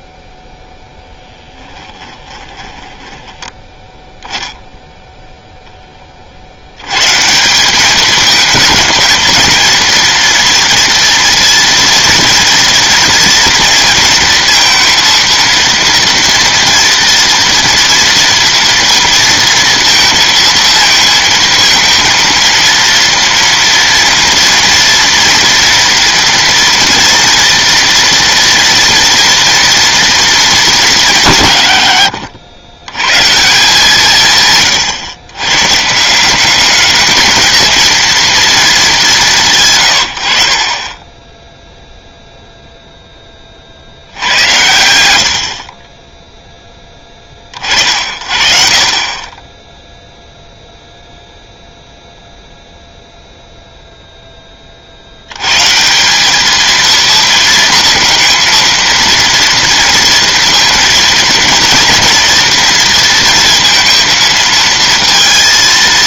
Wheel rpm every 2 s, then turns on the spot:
20, 10, 30, 210, 230, 230, 230, 230, 230, 230, 230, 230, 240, 230, 230, 110, 150, 170, 230, 120, 0, 70, 10, 50, 0, 0, 0, 150, 230, 230, 230, 230, 220.
0-2